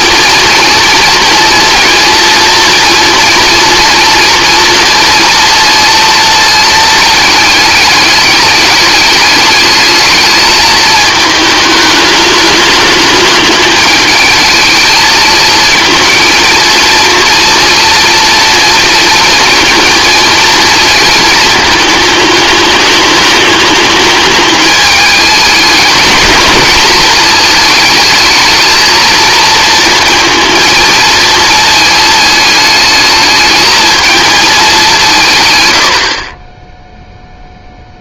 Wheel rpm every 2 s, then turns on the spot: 240, 230, 230, 220, 210, 220, 210, 220, 230, 230, 230, 210, 210, 220, 220, 230, 220, 200, 10.
none